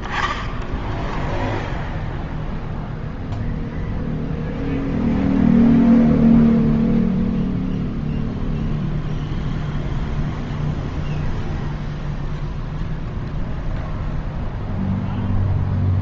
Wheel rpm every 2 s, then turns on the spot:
0, 0, 0, 0, 0, 0, 0, 0.
none